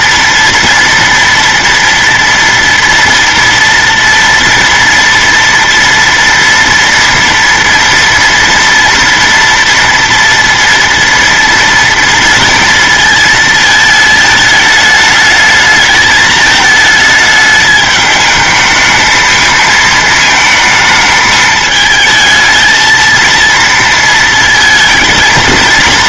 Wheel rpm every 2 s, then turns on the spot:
230, 230, 230, 230, 230, 230, 230, 220, 220, 220, 220, 230, 230.
none